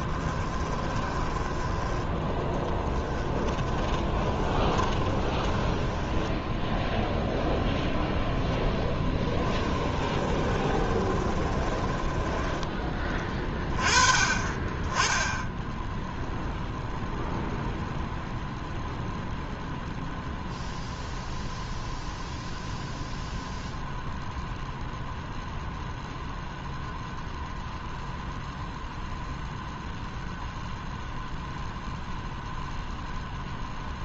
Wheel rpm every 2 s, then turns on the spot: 20, 10, 20, 0, 10, 20, 20, 20, 0, 0, 0, 0, 0, 0, 0, 0, 0.
0-2 4-6 8-12